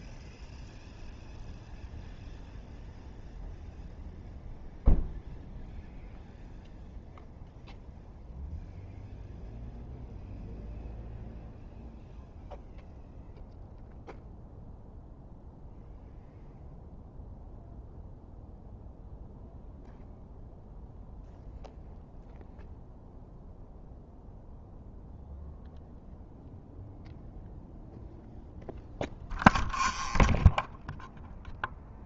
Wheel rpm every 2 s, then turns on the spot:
0, 0, 0, 0, 0, 0, 0, 0, 0, 0, 0, 0, 0, 0, 0, 0.
none